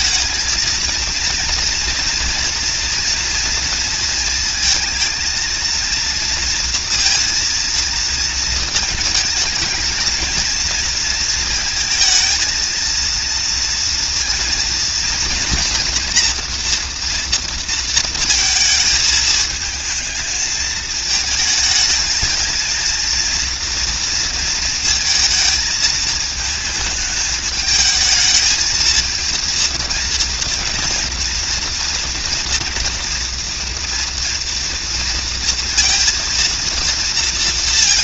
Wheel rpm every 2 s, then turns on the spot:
220, 240, 230, 230, 220, 220, 230, 230, 240, 220, 220, 230, 230, 220, 220, 230, 240, 230, 230.
none